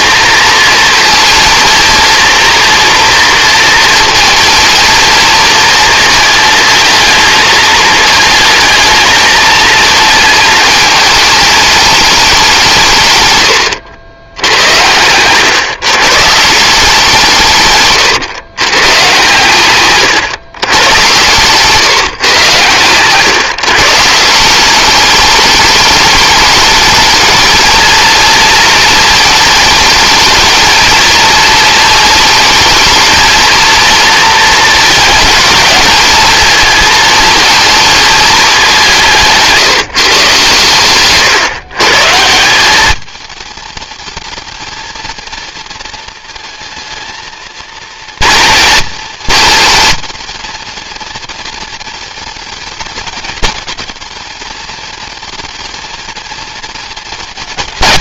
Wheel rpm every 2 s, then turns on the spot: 230, 240, 220, 220, 220, 210, 160, 100, 170, 120, 120, 120, 190, 220, 230, 230, 220, 230, 220, 200, 130, 200, 220, 230, 230, 230, 230, 220, 230.
none